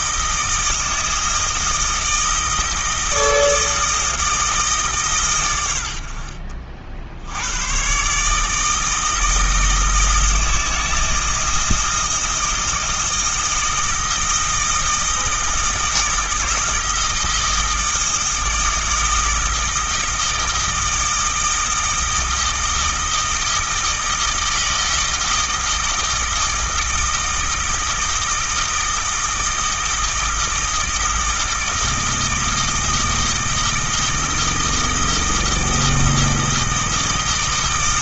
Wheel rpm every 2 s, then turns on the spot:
160, 160, 160, 50, 160, 160, 160, 160, 160, 160, 160, 160, 160, 160, 160, 160, 160, 160, 160.
none